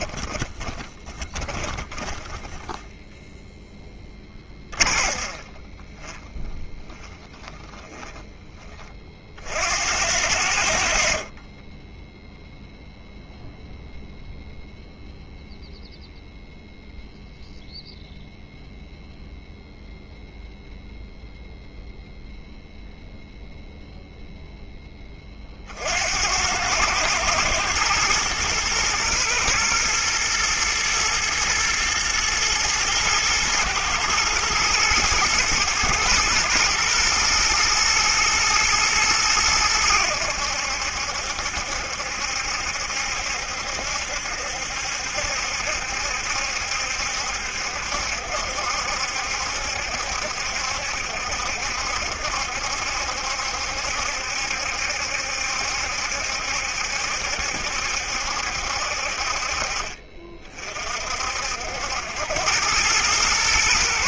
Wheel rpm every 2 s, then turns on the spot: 20, 10, 30, 20, 30, 60, 0, 0, 0, 0, 0, 0, 10, 100, 120, 110, 120, 110, 120, 110, 80, 70, 70, 70, 70, 70, 70, 70, 70, 60, 40, 100.
0-8 10-12